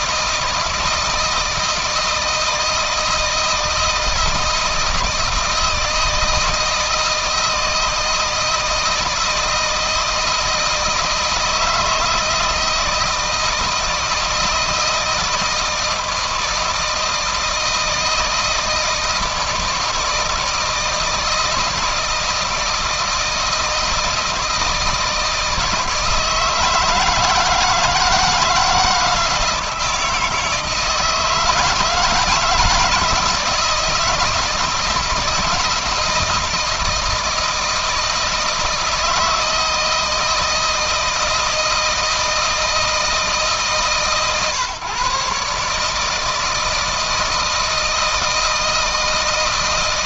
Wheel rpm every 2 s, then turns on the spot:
160, 160, 160, 160, 160, 160, 160, 160, 160, 170, 160, 160, 160, 160, 160, 160, 160, 160, 160, 160, 160, 150, 130, 160, 160.
none